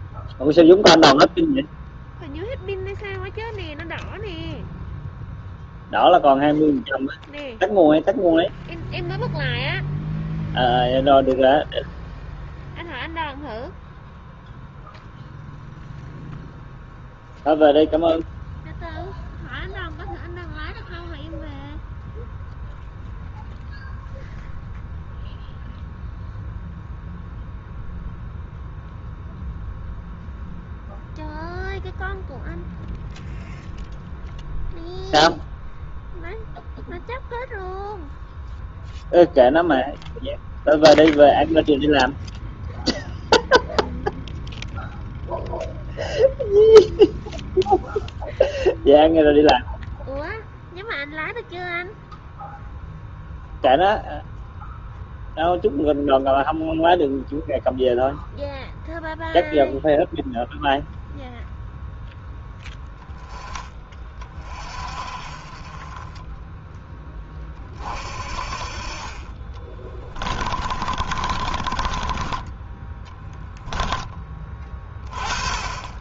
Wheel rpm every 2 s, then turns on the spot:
0, 0, 0, 0, 0, 0, 0, 0, 0, 0, 0, 0, 0, 0, 0, 0, 0, 0, 0, 0, 0, 0, 0, 0, 0, 0, 0, 0, 0, 0, 0, 0, 30, 20, 40, 30, 10, 20.
70-74